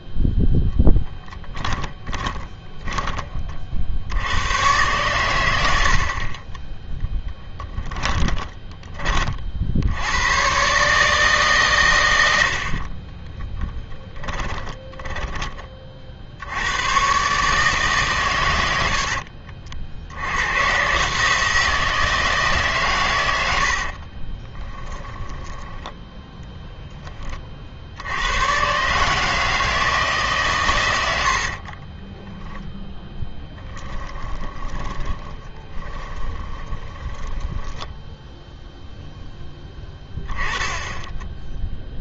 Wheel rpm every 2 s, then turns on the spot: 0, 10, 110, 10, 10, 130, 50, 20, 100, 80, 120, 140, 20, 0, 130, 120, 0, 20, 20, 0, 10.
14-16 18-20 24-26 34-38